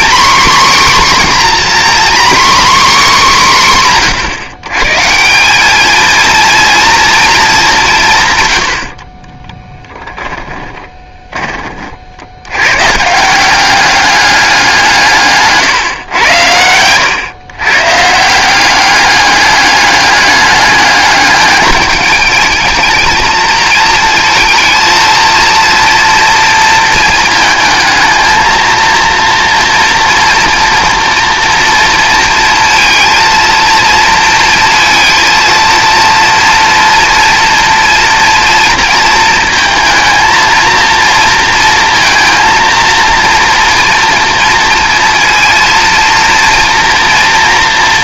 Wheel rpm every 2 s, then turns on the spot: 270, 270, 140, 230, 90, 10, 120, 180, 100, 190, 210, 220, 230, 230, 230, 230, 230, 230, 230, 230, 230, 230, 230, 230.
10-12